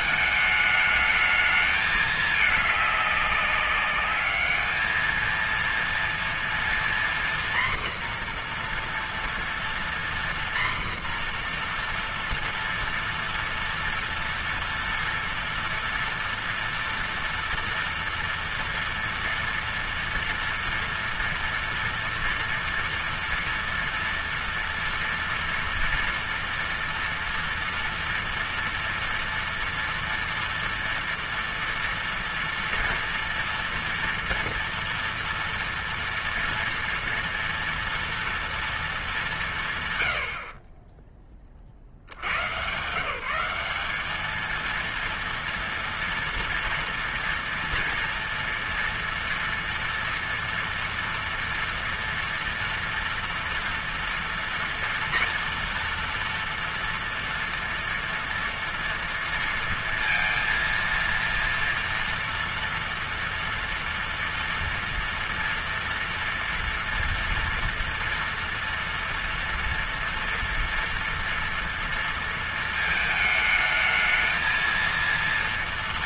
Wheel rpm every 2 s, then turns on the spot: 210, 210, 210, 230, 240, 240, 230, 230, 230, 240, 230, 230, 230, 230, 230, 230, 240, 240, 230, 230, 60, 110, 220, 230, 230, 240, 230, 230, 230, 240, 230, 230, 230, 230, 230, 230, 230, 220.
none